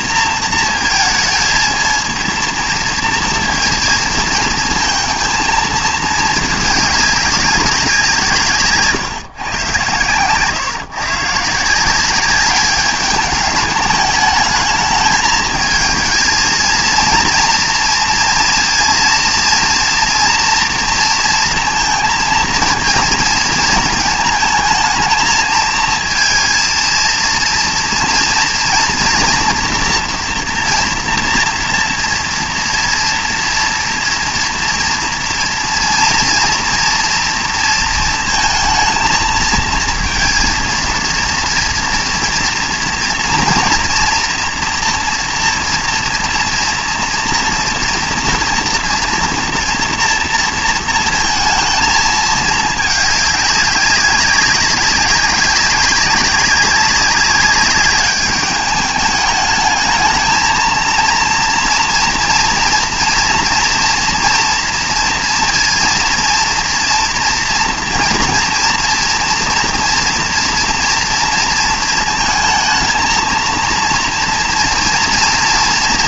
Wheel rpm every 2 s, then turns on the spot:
230, 230, 230, 210, 150, 130, 200, 210, 230, 230, 240, 230, 220, 230, 230, 230, 230, 230, 230, 220, 230, 230, 240, 230, 230, 230, 220, 200, 200, 210, 220, 240, 230, 230, 230, 230, 220, 230.
none